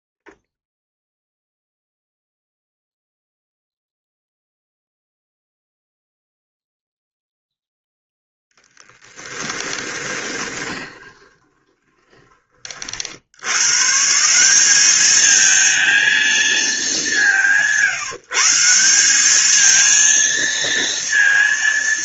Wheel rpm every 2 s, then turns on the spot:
0, 0, 0, 0, 10, 20, 80, 210, 170, 190, 230.
8-12